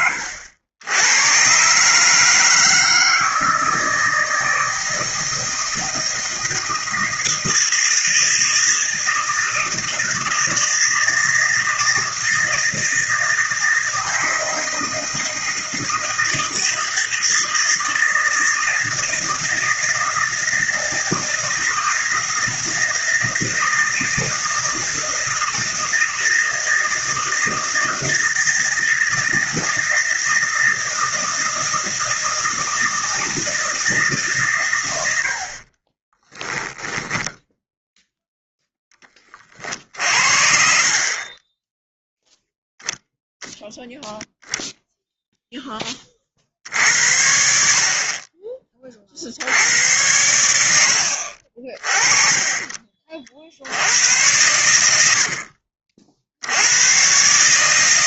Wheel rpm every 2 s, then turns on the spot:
90, 160, 160, 160, 160, 160, 160, 160, 160, 160, 160, 160, 160, 160, 160, 160, 160, 110, 10, 10, 40, 0, 0, 60, 40, 70, 30, 80, 110.
54-56